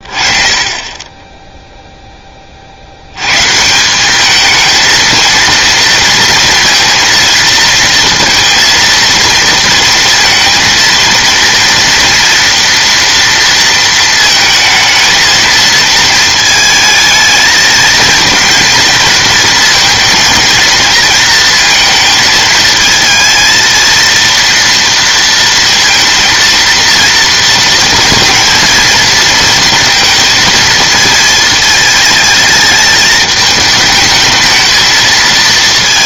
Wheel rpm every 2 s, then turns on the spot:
20, 50, 220, 230, 230, 230, 230, 220, 220, 230, 230, 220, 230, 230, 230, 220, 220, 220.
none